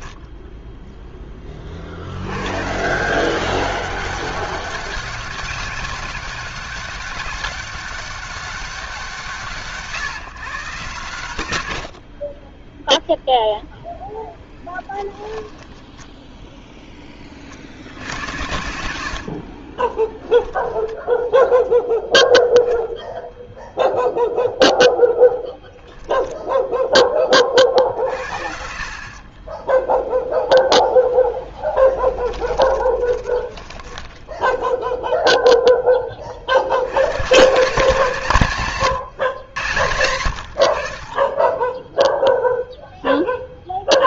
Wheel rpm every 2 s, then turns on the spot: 0, 130, 190, 200, 190, 110, 0, 10, 10, 100, 10, 0, 0, 0, 60, 0, 10, 10, 50, 160, 70, 0.
14-16 32-36